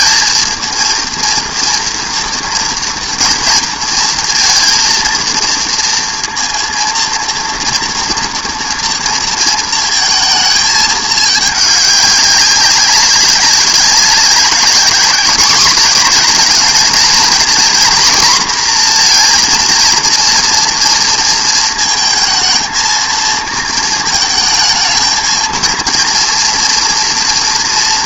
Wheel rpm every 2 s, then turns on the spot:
230, 240, 230, 230, 230, 220, 200, 200, 220, 240, 230, 230, 220, 240.
none